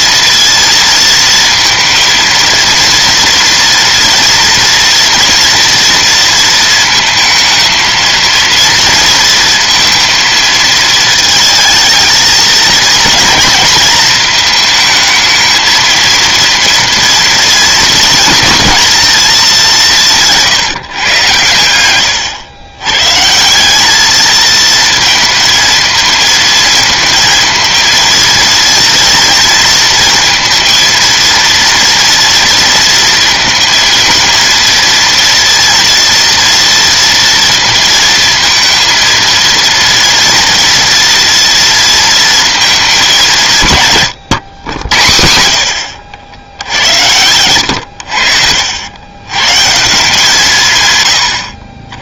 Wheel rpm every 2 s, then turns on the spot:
230, 230, 230, 230, 230, 220, 230, 220, 230, 230, 150, 120, 230, 220, 230, 230, 230, 230, 230, 230, 230, 220, 110, 80, 80, 140.
none